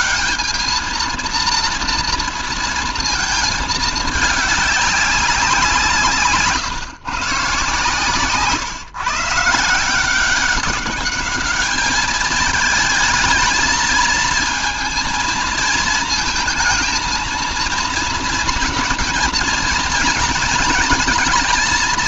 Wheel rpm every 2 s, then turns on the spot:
220, 230, 200, 150, 130, 190, 220, 220, 220, 230, 230.
none